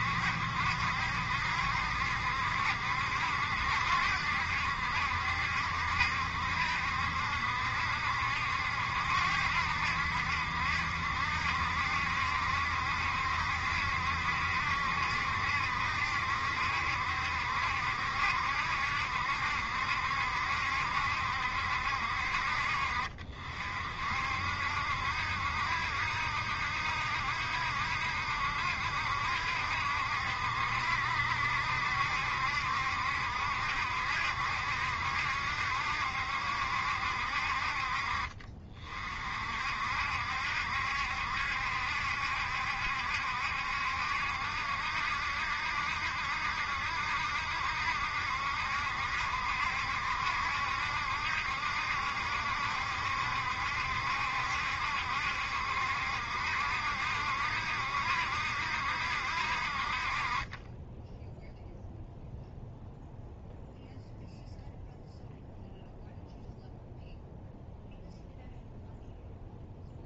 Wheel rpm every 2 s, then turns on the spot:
70, 70, 70, 70, 70, 70, 70, 70, 70, 70, 70, 60, 60, 70, 70, 70, 70, 70, 70, 40, 70, 70, 70, 70, 70, 70, 70, 70, 70, 70, 20, 0, 0, 0, 0.
none